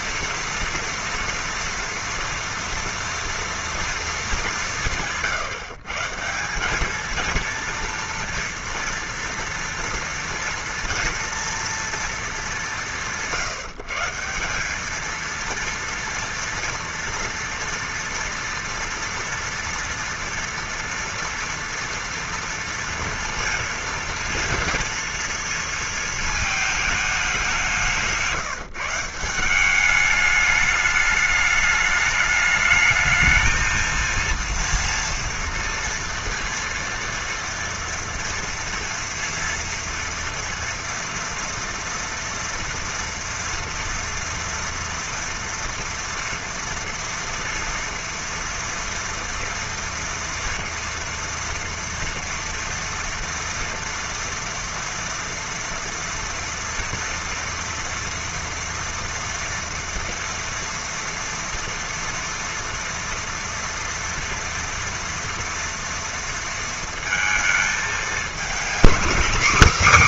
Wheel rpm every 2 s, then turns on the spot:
230, 230, 180, 190, 230, 240, 180, 200, 240, 230, 230, 230, 230, 220, 160, 210, 210, 230, 230, 230, 240, 230, 230, 230, 240, 240, 230, 230, 230, 230, 230, 230, 230, 230, 240.
none